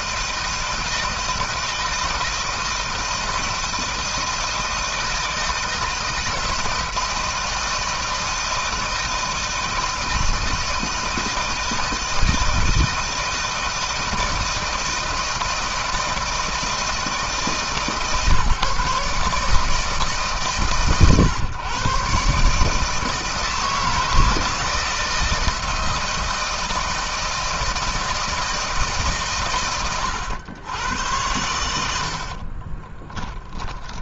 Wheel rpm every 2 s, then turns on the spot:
160, 160, 160, 160, 160, 160, 160, 170, 160, 150, 130, 150, 160, 160, 160, 100, 20.
32-34